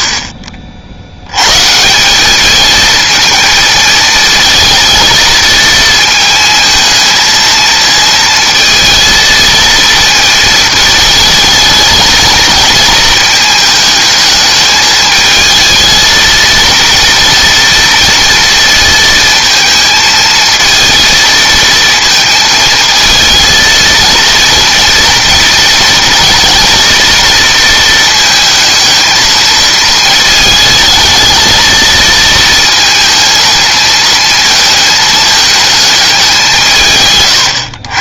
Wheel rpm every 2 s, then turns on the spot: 60, 220, 230, 220, 230, 220, 220, 220, 230, 230, 230, 220, 230, 230, 220, 220, 230, 220, 160.
none